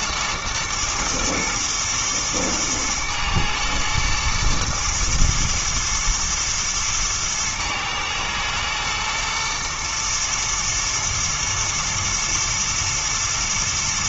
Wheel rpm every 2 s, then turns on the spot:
120, 120, 110, 110, 110, 120, 110.
none